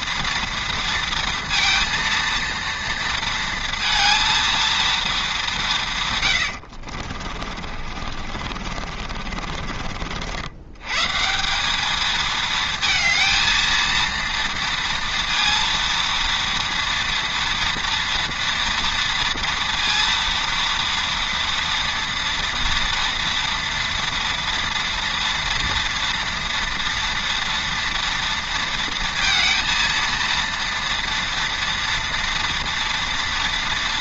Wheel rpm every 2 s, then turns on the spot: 230, 230, 230, 80, 40, 110, 230, 230, 230, 230, 230, 240, 230, 230, 230, 230, 230.
6-10